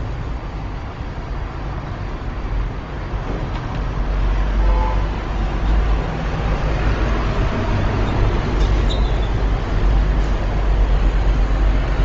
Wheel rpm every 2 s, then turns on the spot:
0, 0, 0, 0, 0, 0.
none